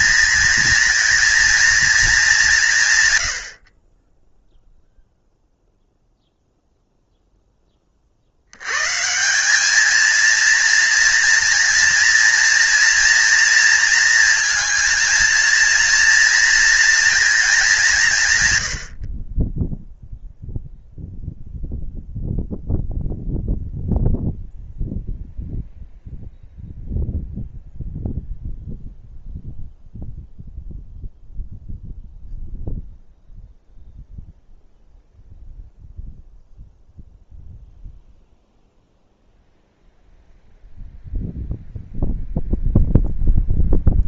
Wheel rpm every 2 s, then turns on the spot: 230, 160, 0, 0, 110, 230, 230, 220, 230, 110, 0, 0, 0, 0, 0, 0, 0, 0, 0, 0, 0, 0.
none